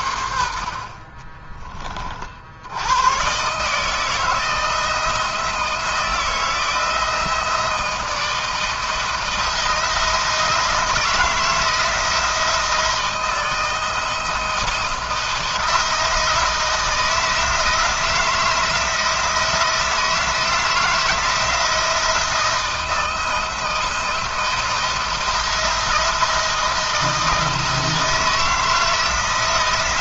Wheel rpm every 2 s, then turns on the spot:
50, 80, 160, 160, 160, 160, 160, 170, 160, 160, 170, 160, 170, 160, 160.
none